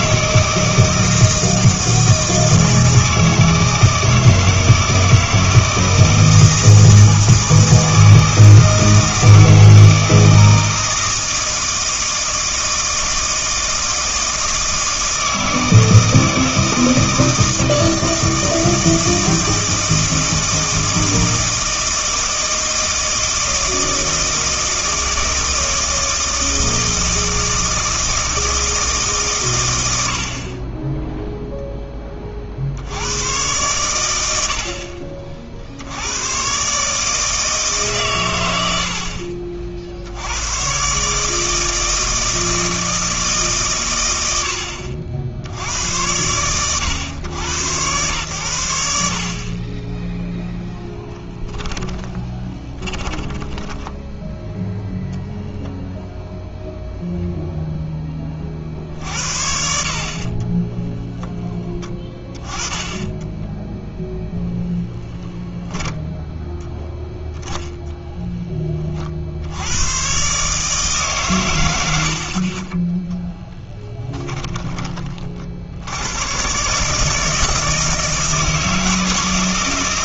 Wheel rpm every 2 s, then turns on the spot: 160, 160, 160, 160, 160, 160, 160, 160, 160, 160, 160, 160, 160, 160, 160, 20, 60, 70, 130, 90, 110, 160, 80, 110, 100, 0, 20, 0, 0, 50, 20, 20, 10, 0, 20, 150, 20, 20, 140, 160.
52-54 60-62